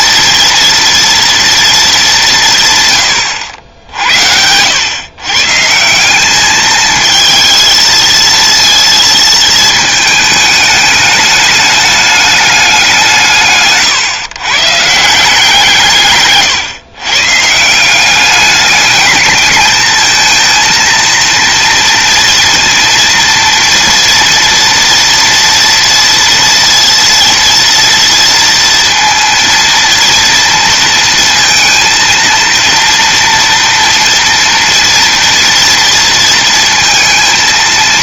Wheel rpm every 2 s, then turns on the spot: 230, 140, 100, 220, 230, 210, 190, 150, 130, 210, 230, 230, 240, 230, 230, 230, 230, 230, 230.
none